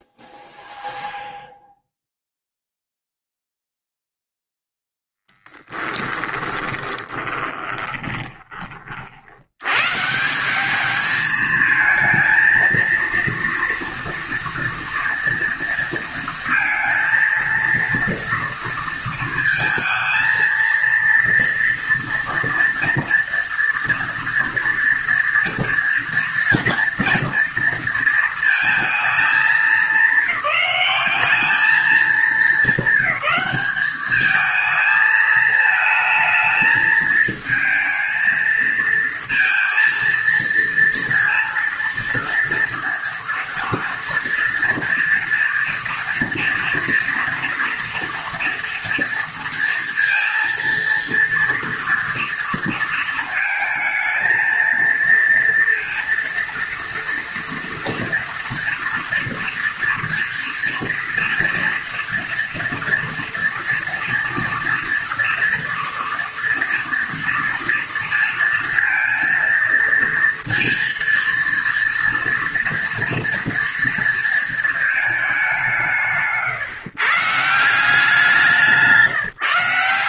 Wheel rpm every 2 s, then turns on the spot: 0, 0, 0, 20, 30, 190, 230, 230, 230, 230, 230, 230, 230, 230, 230, 190, 220, 220, 220, 230, 230, 230, 230, 230, 240, 230, 230, 220, 230, 230, 230, 230, 230, 230, 230, 230, 230, 230, 150, 180.
6-8